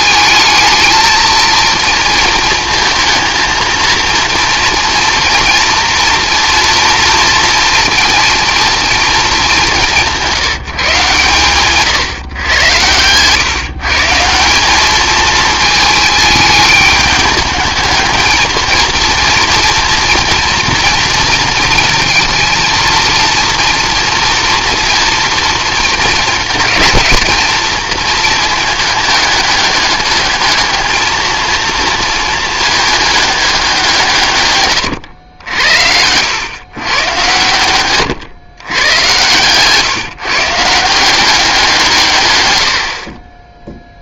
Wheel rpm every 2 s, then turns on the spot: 220, 220, 230, 230, 230, 160, 110, 190, 210, 220, 230, 230, 230, 220, 220, 220, 220, 120, 120, 120, 160, 90.
none